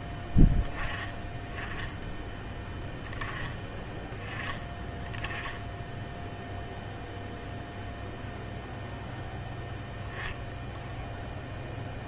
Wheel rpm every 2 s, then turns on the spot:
10, 20, 20, 0, 0, 0.
none